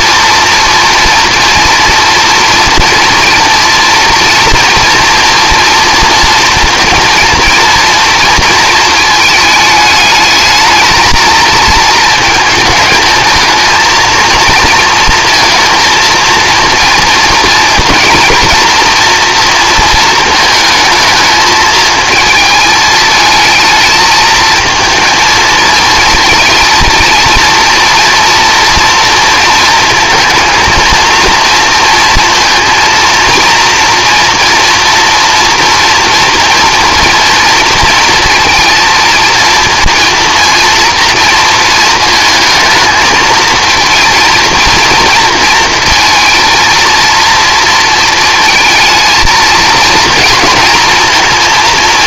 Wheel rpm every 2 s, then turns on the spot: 230, 230, 230, 230, 220, 220, 220, 230, 230, 230, 220, 220, 220, 230, 230, 230, 230, 230, 240, 230, 230, 220, 230, 230, 220, 230.
none